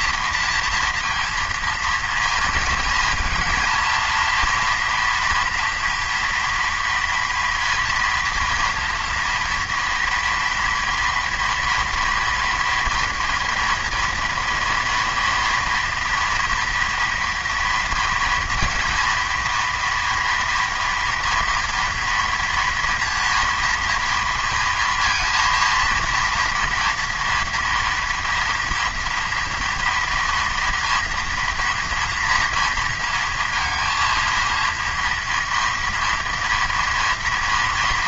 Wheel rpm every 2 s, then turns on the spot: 230, 220, 230, 240, 230, 230, 230, 230, 230, 230, 230, 230, 230, 230, 230, 240, 240, 230, 230.
none